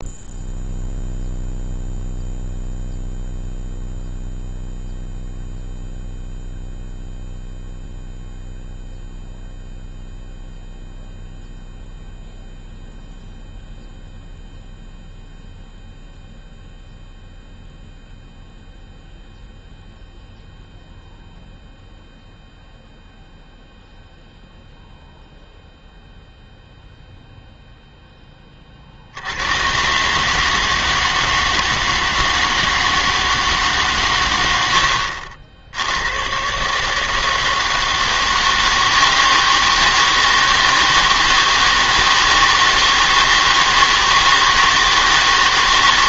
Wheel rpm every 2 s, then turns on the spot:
0, 0, 0, 0, 0, 0, 0, 0, 0, 0, 0, 0, 0, 0, 30, 160, 160, 80, 140, 160, 160, 160, 160.
34-36